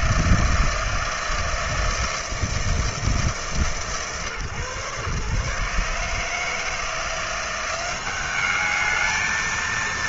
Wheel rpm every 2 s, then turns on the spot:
160, 160, 130, 160, 210.
none